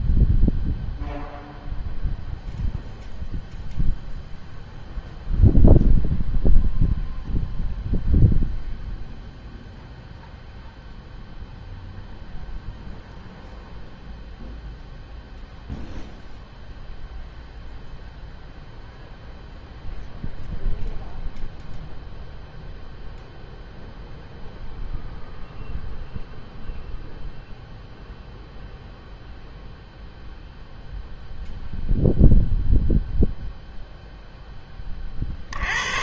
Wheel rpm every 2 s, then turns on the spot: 0, 0, 0, 0, 0, 0, 0, 0, 0, 0, 0, 0, 0, 0, 0, 0, 0, 10.
none